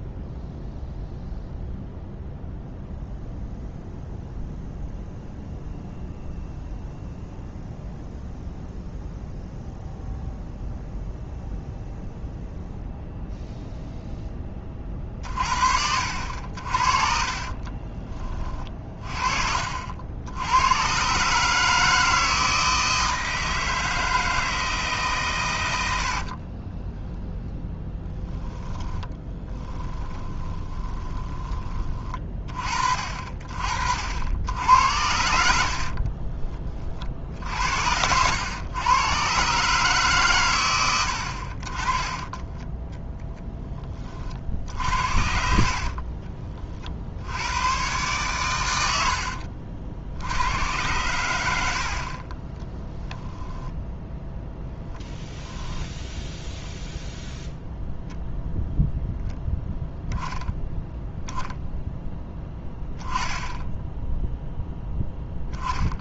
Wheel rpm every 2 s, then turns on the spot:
0, 0, 0, 0, 0, 0, 0, 20, 60, 30, 100, 160, 160, 20, 10, 20, 40, 80, 40, 110, 110, 20, 70, 40, 110, 100, 20, 0, 0, 0, 0, 10, 0.
26-32